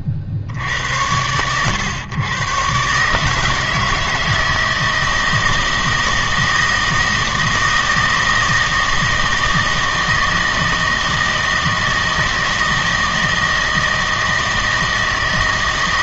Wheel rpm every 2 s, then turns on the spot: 70, 130, 160, 160, 160, 160, 160, 160.
none